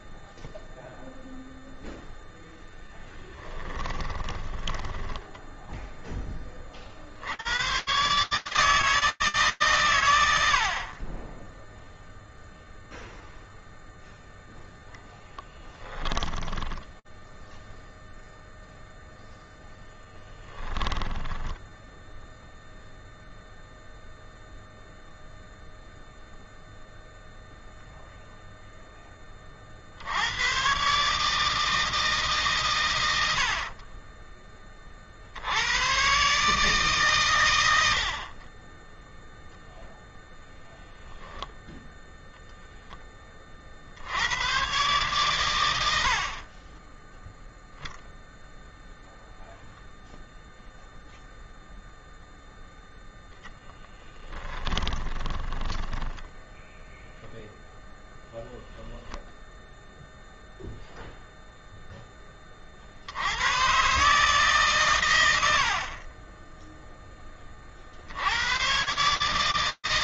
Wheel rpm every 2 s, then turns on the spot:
0, 10, 10, 80, 150, 20, 0, 10, 0, 0, 10, 0, 0, 0, 40, 160, 60, 100, 110, 0, 0, 30, 100, 0, 0, 0, 10, 10, 0, 10, 0, 100, 90, 10, 150.
2-6 14-16 20-22 32-34 54-56